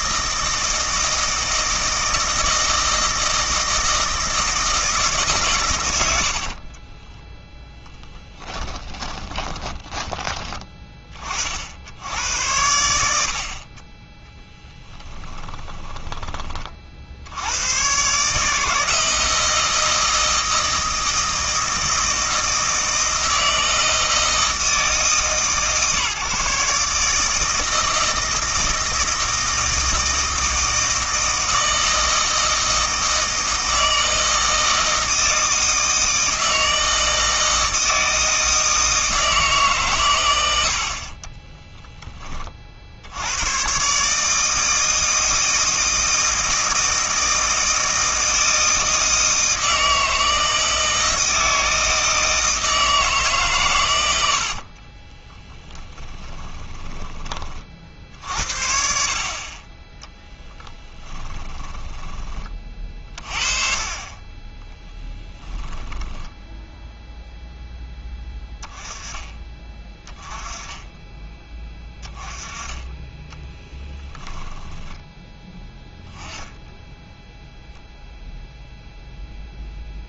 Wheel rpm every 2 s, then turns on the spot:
160, 160, 160, 30, 20, 20, 90, 10, 30, 150, 160, 160, 160, 150, 160, 160, 160, 160, 160, 160, 80, 40, 160, 160, 160, 160, 160, 70, 20, 60, 10, 30, 10, 10, 10, 10, 20, 10, 10, 0.
6-10 14-16 56-58 60-62 66-68 74-76